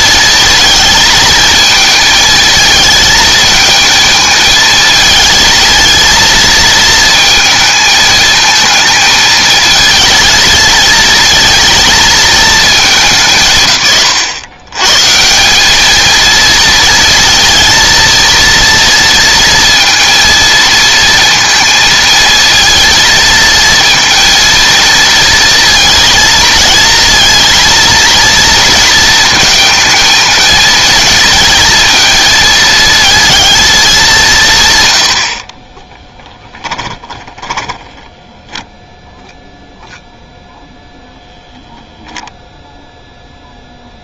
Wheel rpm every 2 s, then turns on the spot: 230, 220, 220, 230, 220, 220, 220, 110, 230, 230, 230, 230, 230, 230, 230, 220, 220, 130, 10, 0, 0, 0.
36-38